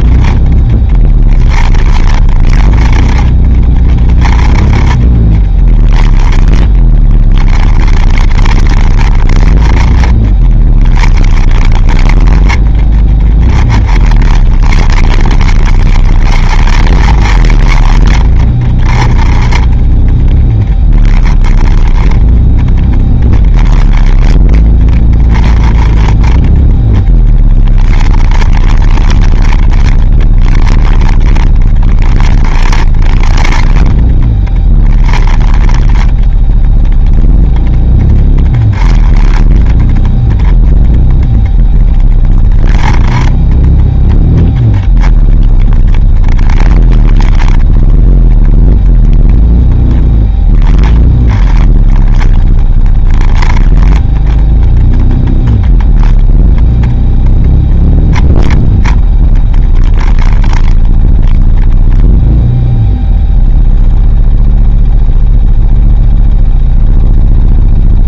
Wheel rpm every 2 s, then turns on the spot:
10, 30, 20, 20, 40, 20, 20, 30, 40, 30, 20, 10, 20, 10, 20, 30, 40, 20, 10, 10, 0, 10, 0, 20, 0, 10, 20, 10, 0, 10, 10, 0, 0, 0.
none